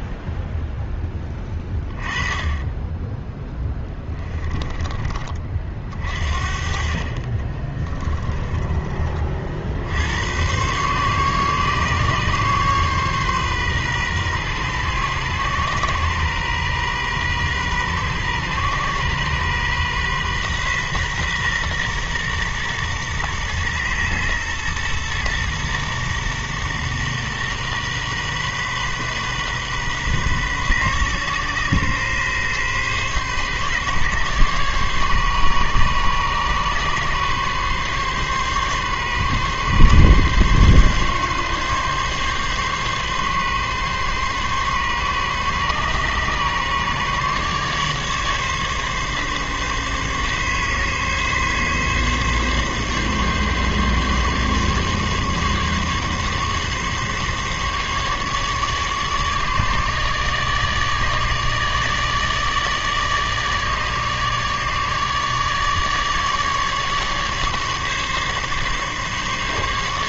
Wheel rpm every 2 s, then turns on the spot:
0, 10, 20, 50, 30, 120, 140, 130, 130, 130, 130, 120, 120, 120, 130, 130, 130, 140, 140, 140, 140, 140, 140, 140, 140, 140, 140, 140, 140, 150, 150, 150, 150, 150, 140.
4-6 8-10